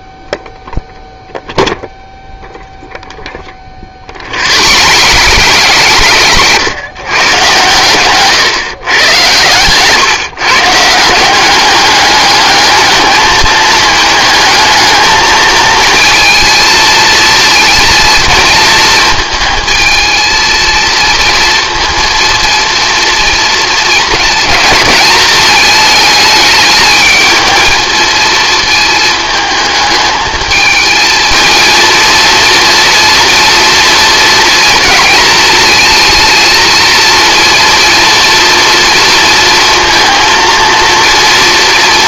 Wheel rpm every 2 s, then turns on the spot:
0, 0, 70, 100, 130, 150, 210, 220, 220, 220, 230, 230, 220, 220, 220, 220, 230, 230, 230, 230, 230.
4-6 8-10